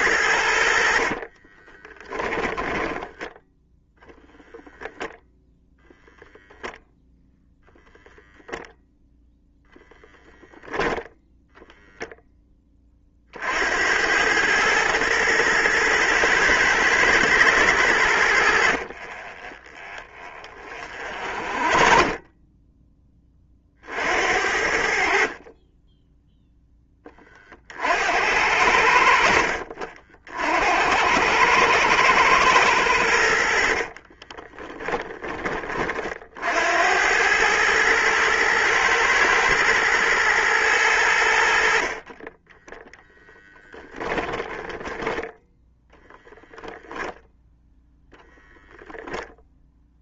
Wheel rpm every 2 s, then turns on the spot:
80, 10, 0, 0, 0, 0, 10, 110, 110, 60, 30, 10, 70, 10, 70, 70, 110, 30, 60, 110, 110, 10, 10, 0, 0.
2-4 18-24 34-36 42-46